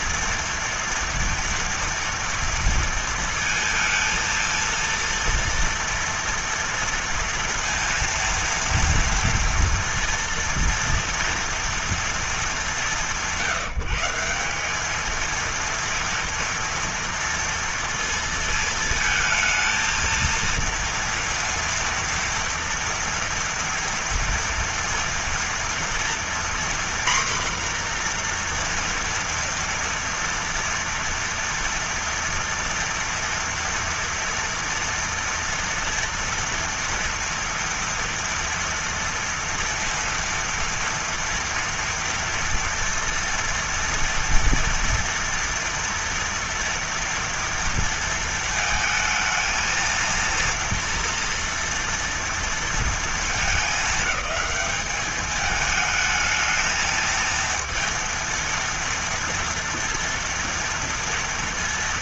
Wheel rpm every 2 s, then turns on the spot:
230, 230, 230, 230, 230, 230, 200, 200, 230, 230, 230, 230, 230, 240, 240, 230, 230, 230, 230, 230, 230, 230, 230, 230, 220, 230, 230, 200, 220, 230, 230.
none